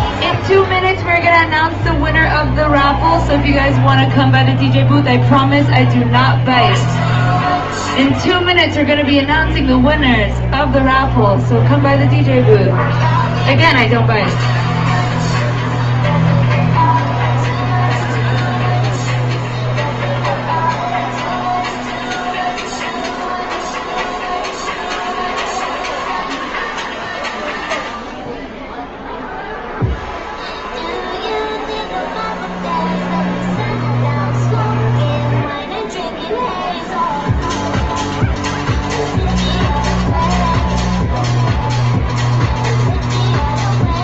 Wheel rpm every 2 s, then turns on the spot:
0, 0, 0, 0, 0, 0, 0, 0, 0, 0, 0, 0, 0, 0, 0, 0, 0, 0, 0, 0, 0, 0.
none